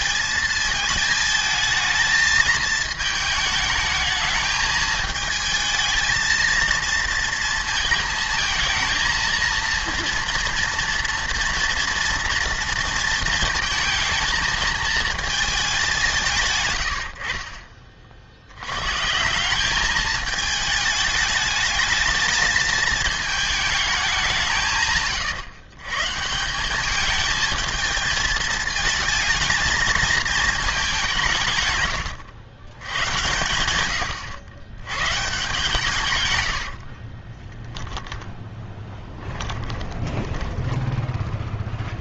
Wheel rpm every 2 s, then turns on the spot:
230, 220, 220, 230, 220, 230, 230, 220, 90, 110, 210, 210, 150, 190, 220, 210, 100, 100, 80, 10, 10.
36-42